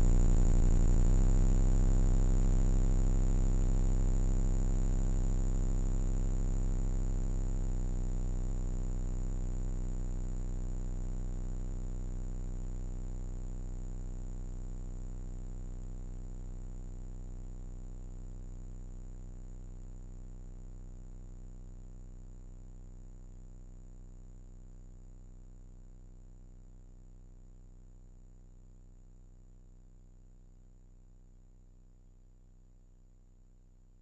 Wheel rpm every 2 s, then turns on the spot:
60, 10, 10, 10, 0, 0, 0, 0, 0, 0, 10, 0, 0, 0, 0, 0, 0.
4-6 20-22